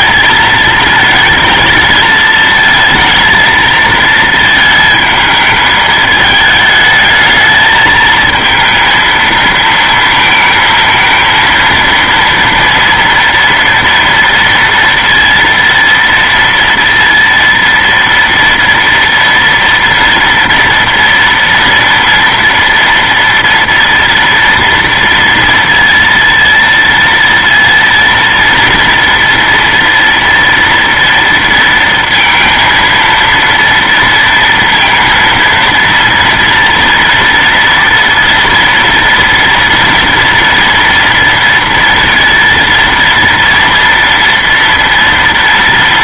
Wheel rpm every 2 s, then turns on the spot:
220, 220, 220, 220, 220, 220, 230, 230, 230, 230, 230, 230, 240, 230, 230, 230, 230, 230, 230, 230, 230, 230, 230.
none